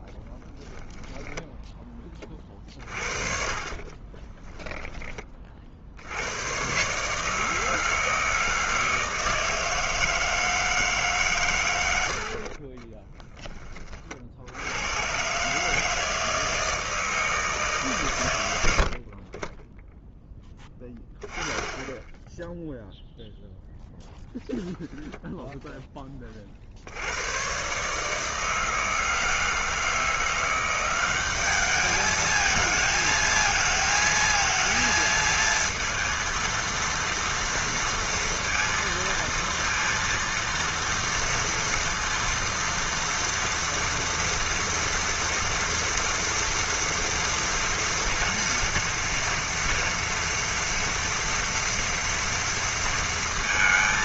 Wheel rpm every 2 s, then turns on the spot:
40, 40, 20, 120, 160, 160, 50, 80, 160, 90, 10, 10, 0, 40, 160, 180, 220, 230, 230, 230, 230, 230, 230, 230, 230, 230, 230.
0-6 12-14